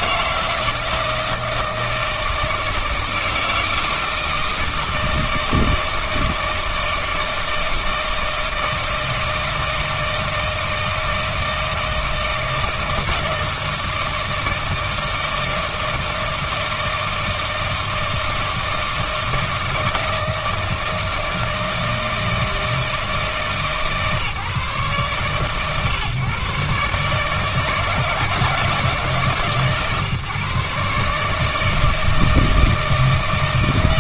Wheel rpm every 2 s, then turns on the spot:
160, 160, 160, 160, 160, 160, 160, 160, 160, 160, 160, 160, 140, 140, 150, 140, 160.
none